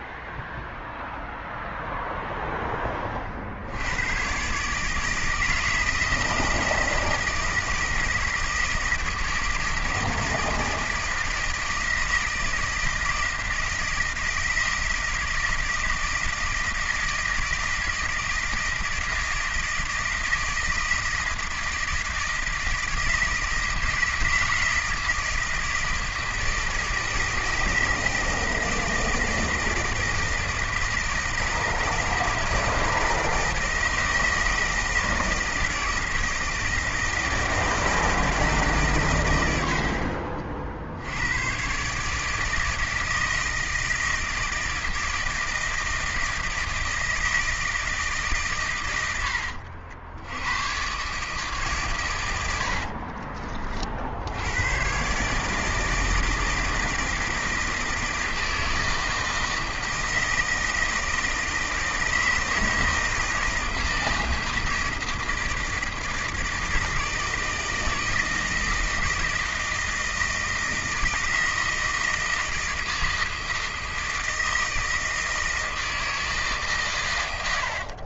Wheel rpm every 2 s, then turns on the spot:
0, 10, 140, 160, 160, 160, 160, 160, 160, 160, 160, 160, 160, 160, 160, 160, 160, 160, 160, 150, 60, 160, 160, 160, 120, 110, 80, 110, 160, 160, 160, 160, 160, 160, 160, 160, 170, 160, 140.
52-54